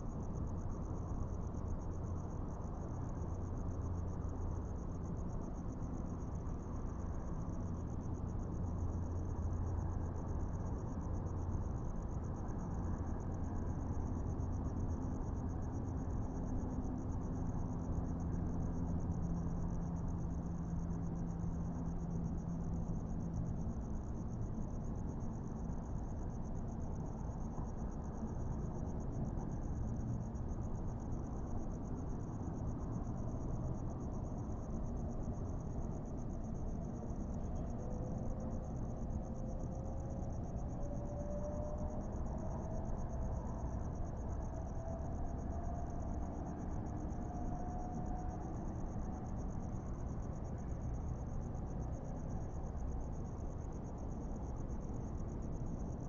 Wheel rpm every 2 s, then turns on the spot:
0, 0, 0, 0, 0, 0, 0, 0, 0, 0, 0, 0, 0, 0, 0, 0, 0, 0, 0, 0, 0, 0, 0, 0, 0, 0, 0, 0.
none